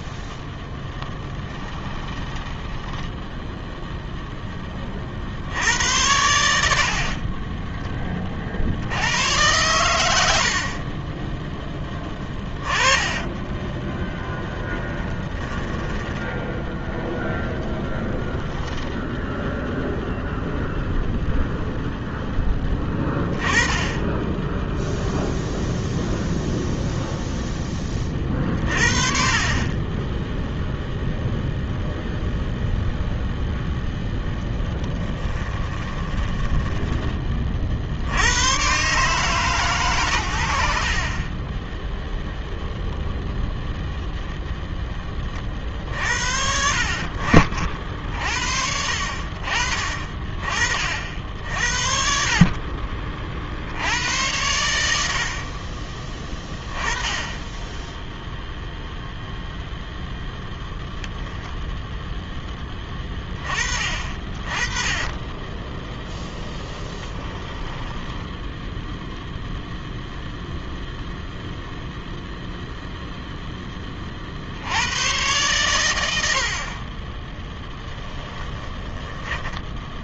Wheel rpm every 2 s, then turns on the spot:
10, 10, 30, 80, 70, 30, 20, 10, 0, 0, 0, 20, 0, 0, 30, 0, 0, 10, 10, 120, 50, 0, 10, 60, 60, 40, 30, 90, 20, 0, 0, 10, 20, 10, 10, 0, 0, 100, 30, 10.
0-4 12-16 34-36 66-70 78-80